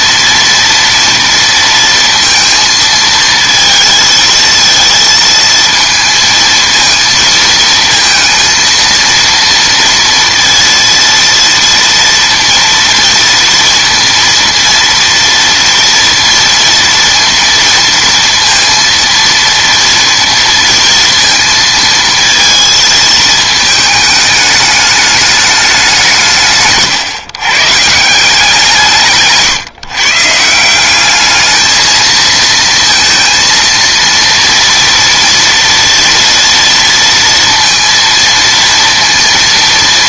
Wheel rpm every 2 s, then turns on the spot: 230, 220, 220, 220, 230, 230, 230, 230, 230, 230, 230, 220, 210, 140, 170, 180, 230, 230, 230, 230.
none